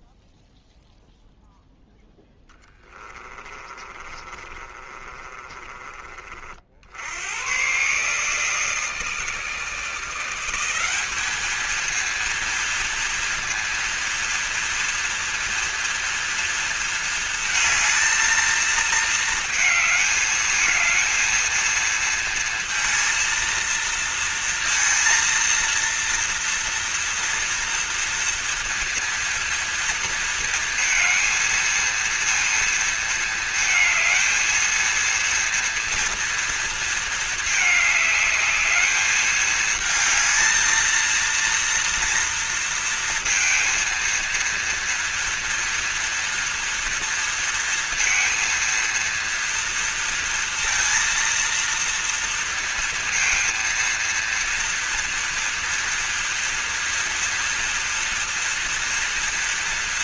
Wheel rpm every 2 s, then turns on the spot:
0, 10, 30, 40, 150, 180, 230, 230, 230, 220, 220, 220, 230, 240, 240, 230, 230, 220, 230, 210, 220, 230, 230, 230, 230, 230, 230, 230, 230, 230.
2-6